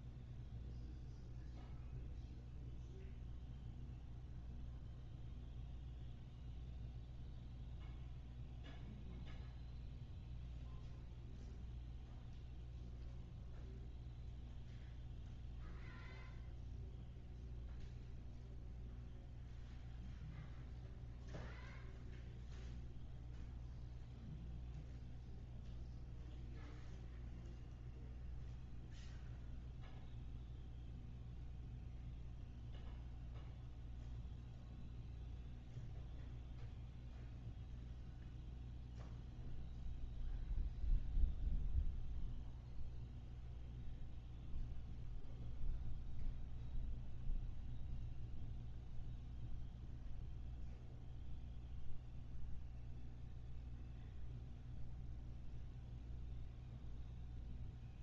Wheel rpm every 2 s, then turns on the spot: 0, 0, 0, 0, 0, 0, 0, 0, 0, 0, 0, 0, 0, 0, 0, 0, 0, 0, 0, 0, 0, 0, 0, 0, 0, 0, 0, 0, 0.
none